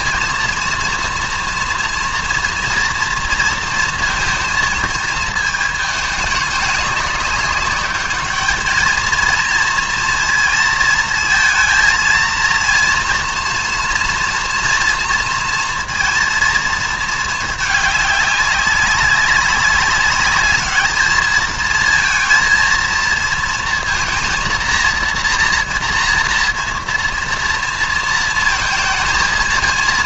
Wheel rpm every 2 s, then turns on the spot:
230, 230, 220, 210, 220, 230, 230, 230, 230, 200, 210, 230, 230, 230, 230.
none